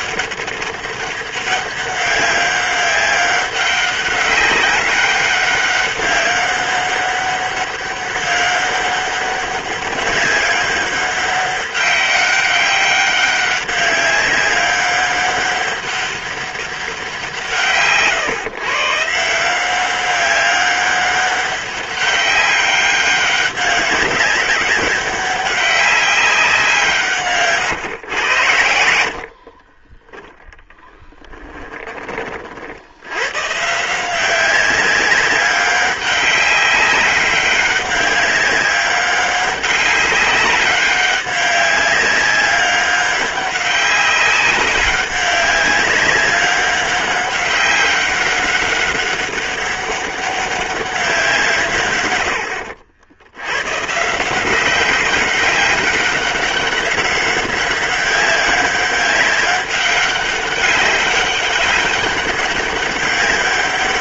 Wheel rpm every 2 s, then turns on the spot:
200, 190, 200, 200, 200, 200, 200, 200, 200, 150, 200, 200, 200, 190, 90, 0, 40, 180, 200, 190, 200, 200, 200, 200, 200, 200, 110, 180, 200, 200, 200, 200.
none